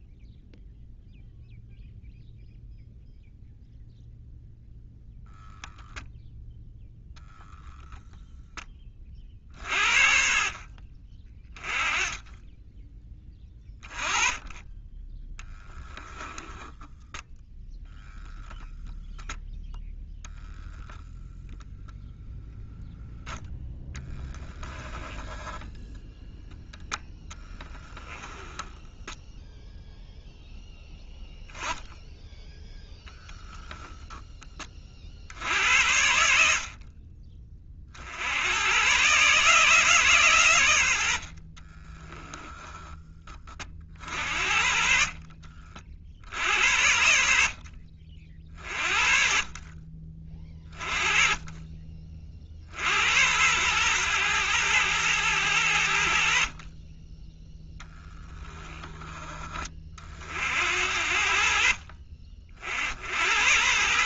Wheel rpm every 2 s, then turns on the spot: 0, 0, 0, 0, 30, 30, 20, 10, 0, 0, 0, 0, 10, 0, 10, 10, 0, 50, 40, 140, 70, 20, 50, 70, 50, 30, 80, 110, 10, 10, 70, 70.
24-26